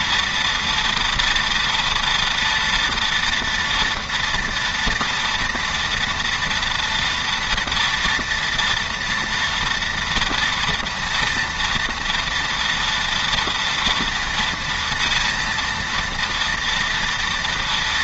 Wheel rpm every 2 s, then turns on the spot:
230, 230, 230, 230, 230, 230, 230, 230, 240.
none